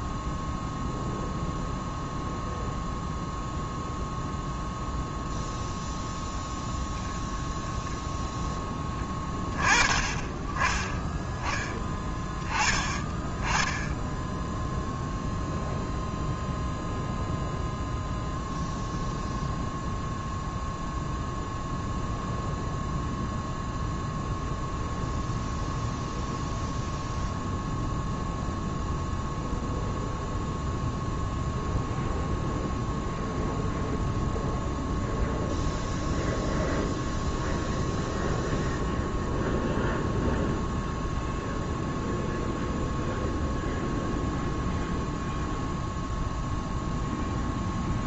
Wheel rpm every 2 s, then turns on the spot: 0, 0, 0, 0, 10, 10, 10, 0, 0, 0, 0, 0, 0, 0, 0, 0, 0, 0, 0, 0, 0, 0, 0, 0.
none